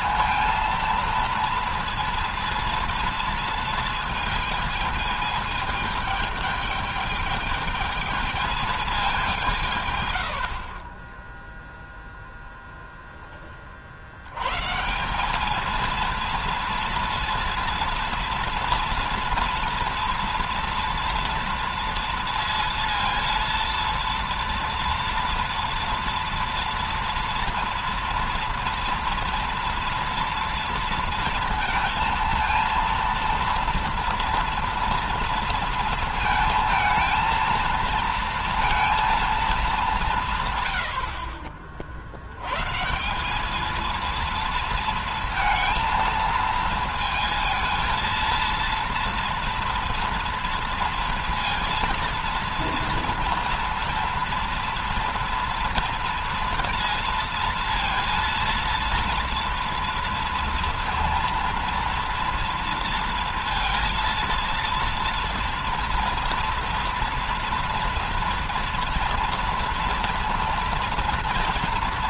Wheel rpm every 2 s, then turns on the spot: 230, 230, 220, 210, 220, 70, 0, 110, 230, 230, 230, 230, 230, 230, 230, 230, 230, 240, 230, 230, 160, 100, 230, 230, 230, 230, 230, 240, 230, 230, 230, 230, 230, 230, 230, 230.
40-42